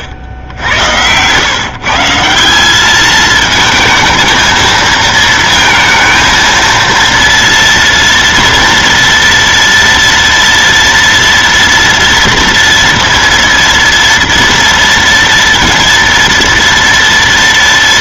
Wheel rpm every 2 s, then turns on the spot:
90, 200, 230, 230, 230, 230, 230, 230, 230.
none